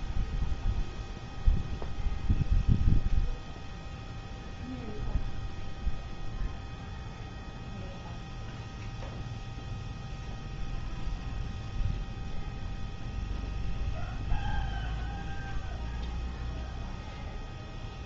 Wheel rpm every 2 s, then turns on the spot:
0, 0, 0, 0, 0, 0, 0, 0, 0.
none